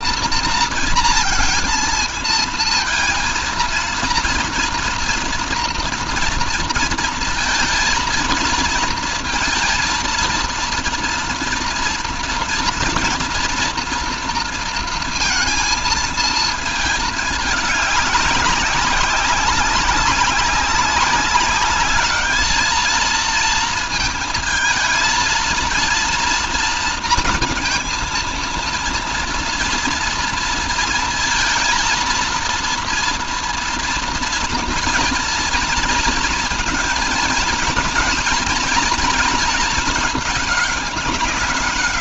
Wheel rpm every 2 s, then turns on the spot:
230, 230, 230, 220, 230, 230, 230, 220, 210, 200, 200, 220, 230, 230, 230, 230, 230, 240, 230, 230, 200.
none